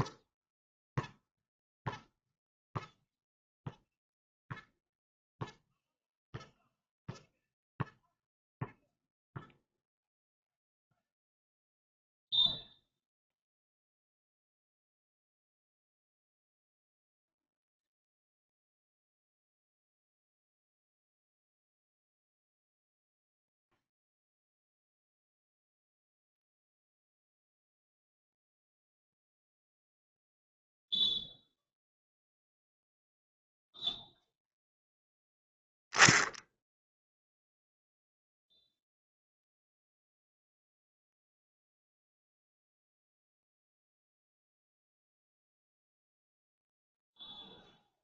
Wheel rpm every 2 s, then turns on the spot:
0, 0, 0, 0, 0, 0, 0, 0, 0, 0, 0, 0, 0, 0, 0, 0, 0, 0, 0, 0, 0, 0, 0, 0.
none